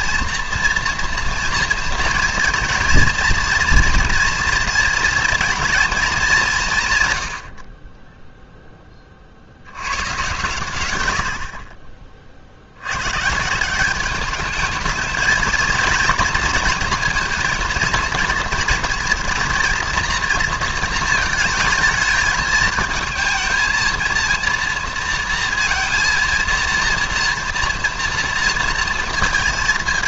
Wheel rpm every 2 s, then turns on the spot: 230, 230, 230, 160, 10, 120, 70, 210, 230, 230, 230, 220, 230, 230, 230.
none